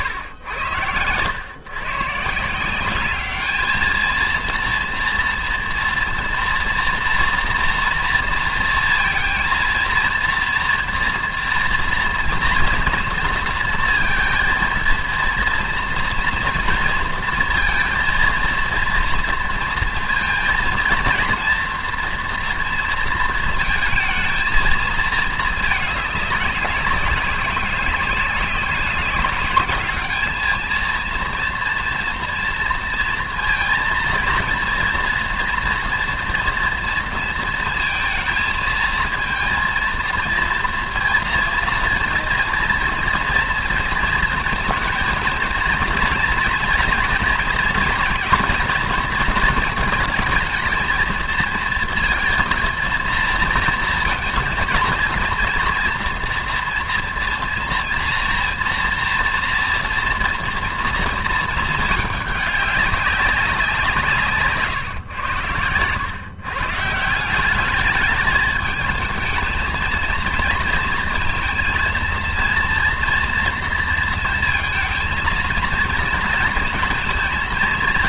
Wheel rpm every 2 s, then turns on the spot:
100, 200, 230, 240, 230, 230, 230, 230, 230, 230, 230, 230, 220, 200, 190, 220, 230, 230, 230, 230, 230, 230, 220, 230, 230, 230, 220, 230, 240, 230, 230, 200, 120, 160, 220, 220, 230, 230, 230.
none